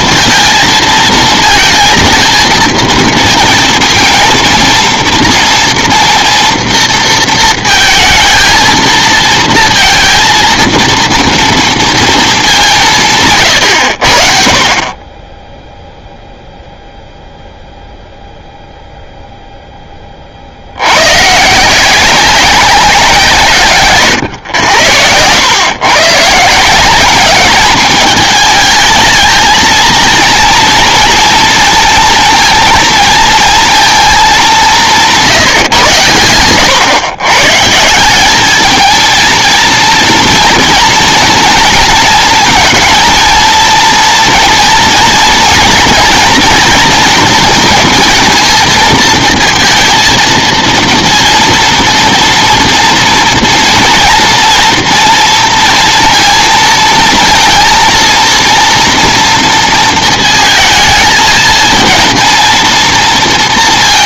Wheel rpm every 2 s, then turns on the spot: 230, 220, 230, 230, 230, 230, 210, 50, 0, 0, 80, 190, 100, 160, 220, 230, 230, 190, 110, 220, 230, 220, 230, 230, 230, 230, 230, 230, 230, 230, 220, 230.
none